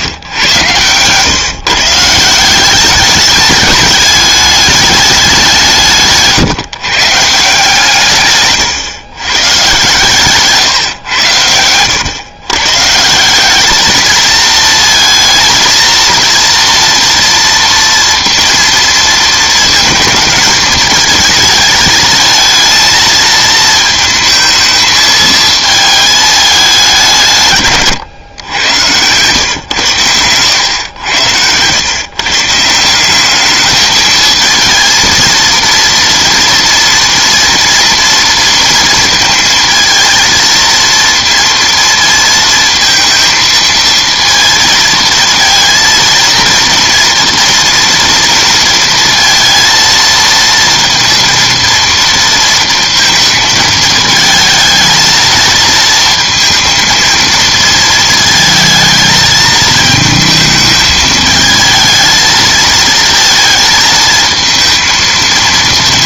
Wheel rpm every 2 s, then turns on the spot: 100, 180, 210, 150, 140, 140, 120, 220, 230, 230, 220, 220, 220, 200, 110, 110, 150, 220, 230, 230, 230, 230, 230, 230, 230, 230, 230, 220, 220, 220, 220, 220, 230.
none